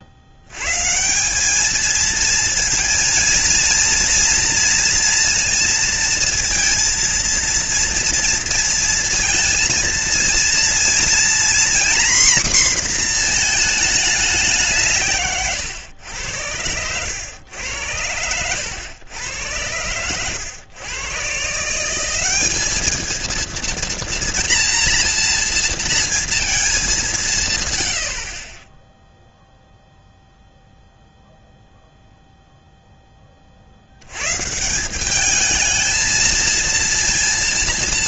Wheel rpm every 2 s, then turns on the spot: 120, 230, 230, 230, 230, 230, 250, 180, 90, 100, 110, 200, 230, 220, 20, 0, 0, 150, 230.
none